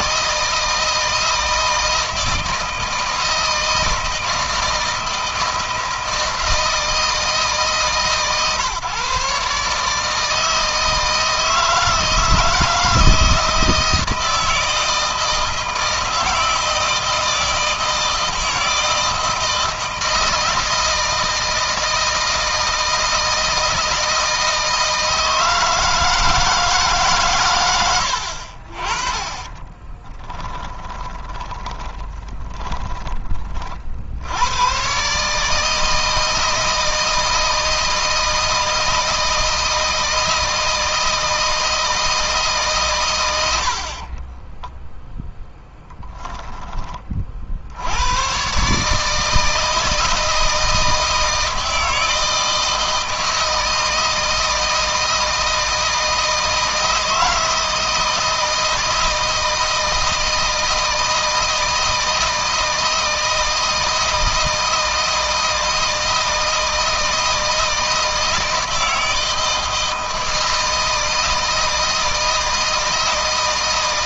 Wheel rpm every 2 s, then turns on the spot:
160, 160, 160, 160, 150, 160, 160, 160, 160, 160, 160, 160, 160, 160, 50, 20, 20, 100, 160, 160, 160, 150, 20, 10, 120, 160, 160, 160, 160, 160, 160, 160, 160, 160, 160, 160, 160.
30-34 44-46